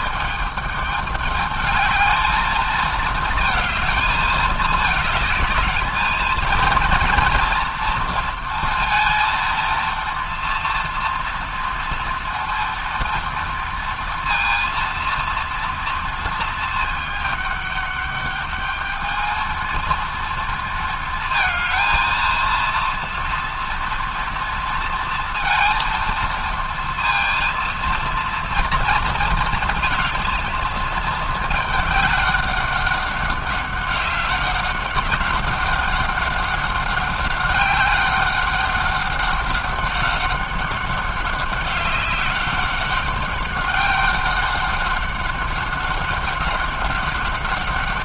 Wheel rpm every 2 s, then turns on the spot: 210, 220, 220, 220, 230, 230, 230, 230, 220, 210, 230, 230, 230, 230, 230, 220, 200, 190, 190, 200, 200, 190, 190, 190.
none